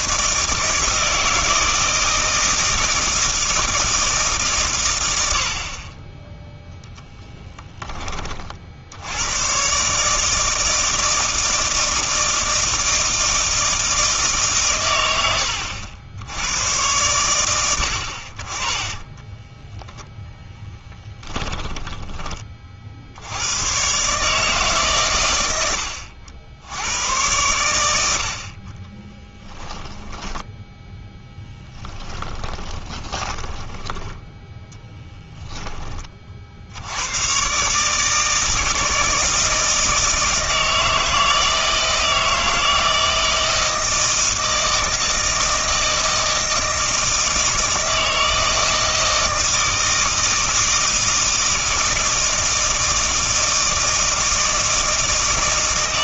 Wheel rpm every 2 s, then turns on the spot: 160, 160, 130, 0, 50, 160, 160, 120, 100, 30, 10, 40, 140, 90, 30, 10, 20, 10, 80, 160, 160, 160, 160, 160, 160, 160, 160, 160.
20-22 28-30 32-34